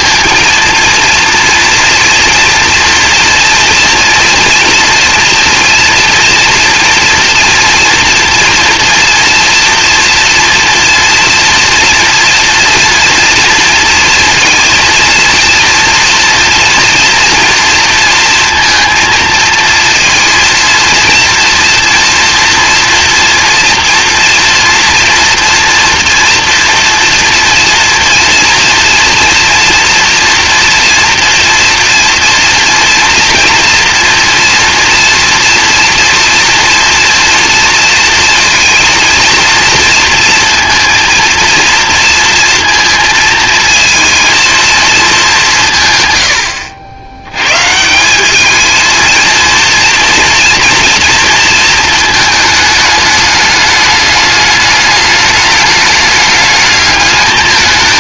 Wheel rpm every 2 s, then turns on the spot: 230, 230, 230, 230, 230, 230, 230, 230, 230, 230, 230, 230, 230, 240, 230, 240, 240, 230, 230, 230, 230, 230, 230, 80, 220, 230, 220, 210, 210.
none